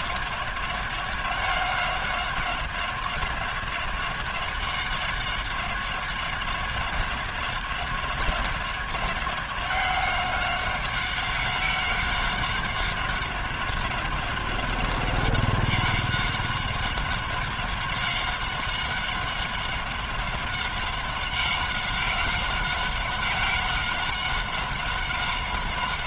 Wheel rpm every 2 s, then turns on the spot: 190, 190, 190, 190, 190, 190, 190, 190, 190, 190, 190, 190, 190.
none